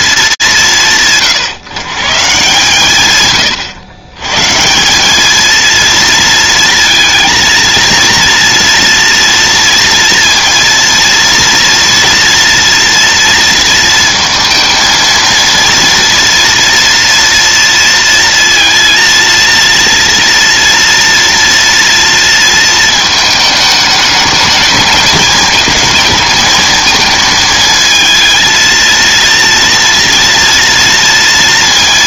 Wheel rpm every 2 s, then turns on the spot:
140, 130, 190, 230, 230, 230, 230, 230, 230, 230, 230, 220, 220, 220, 230, 230.
none